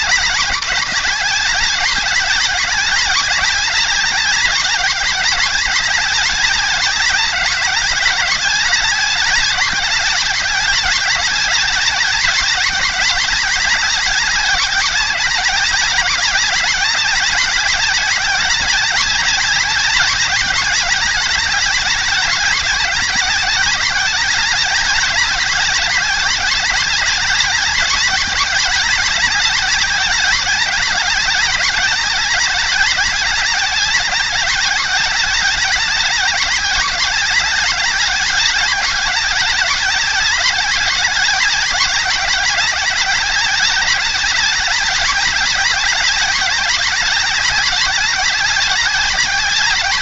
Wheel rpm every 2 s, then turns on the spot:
190, 190, 190, 180, 190, 200, 200, 190, 190, 200, 190, 190, 200, 200, 200, 200, 200, 190, 200, 190, 190, 190, 200, 190, 190.
none